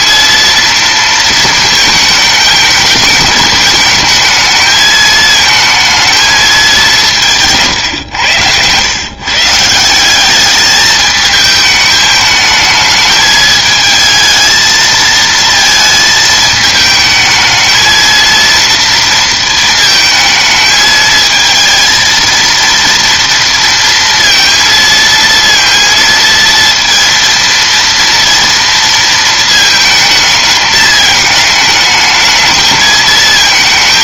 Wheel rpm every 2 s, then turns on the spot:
230, 220, 220, 150, 130, 210, 210, 220, 220, 230, 220, 230, 230, 230, 230, 210, 220.
none